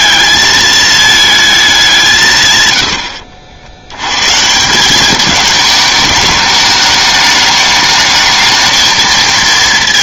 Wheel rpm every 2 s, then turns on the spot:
220, 110, 170, 210, 220.
none